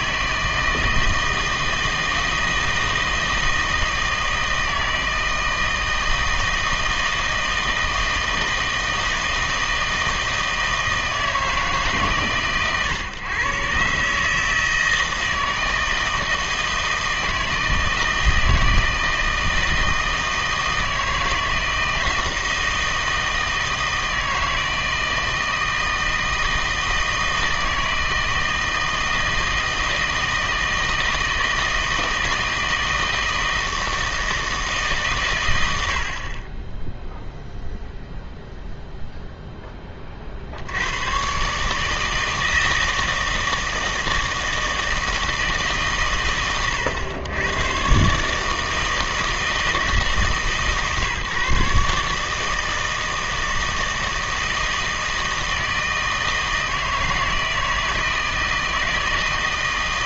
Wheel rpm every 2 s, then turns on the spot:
160, 160, 160, 160, 160, 160, 130, 160, 160, 160, 160, 160, 160, 160, 160, 160, 160, 160, 20, 0, 80, 160, 160, 100, 150, 150, 160, 160, 160, 160.
none